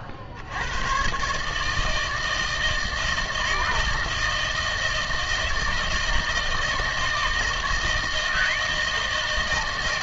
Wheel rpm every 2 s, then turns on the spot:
100, 160, 160, 160, 160.
none